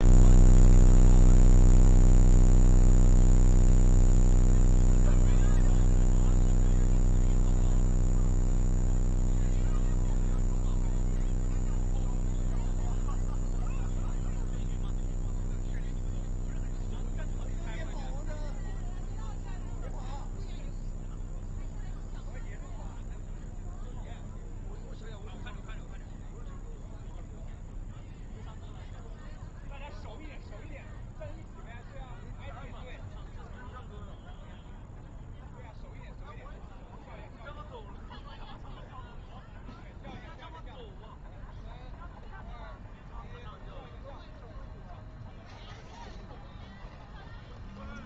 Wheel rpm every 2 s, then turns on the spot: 0, 0, 0, 0, 0, 0, 0, 0, 0, 0, 0, 0, 0, 0, 0, 0, 0, 0, 0, 0, 0, 0, 0, 0.
none